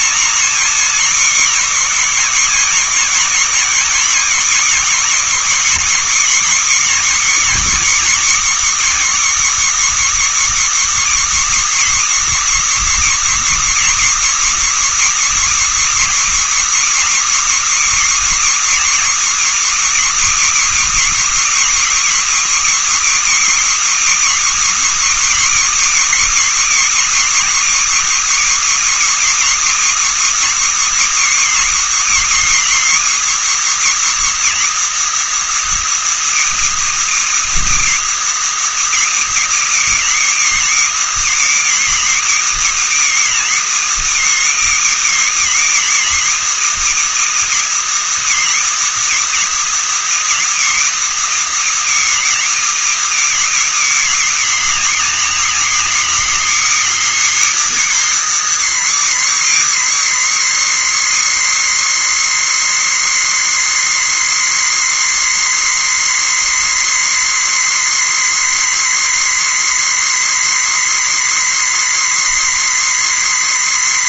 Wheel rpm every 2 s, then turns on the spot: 270, 250, 260, 290, 300, 320, 320, 320, 320, 320, 320, 320, 320, 310, 310, 310, 310, 330, 330, 330, 320, 310, 310, 320, 320, 320, 320, 300, 310, 320, 310, 310, 310, 310, 310, 310, 300.
none